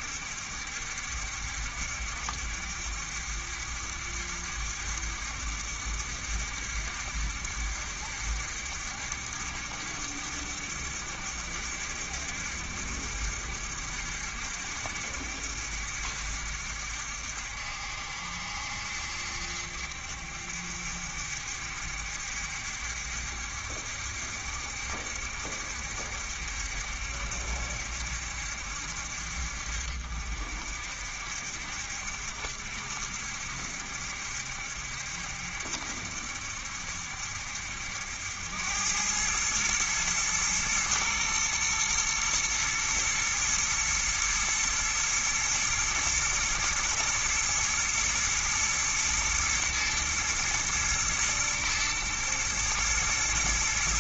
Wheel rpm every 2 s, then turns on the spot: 70, 70, 70, 70, 70, 70, 70, 70, 70, 70, 70, 70, 70, 70, 70, 60, 70, 70, 70, 90, 110, 110, 110, 120, 110, 110, 110.
none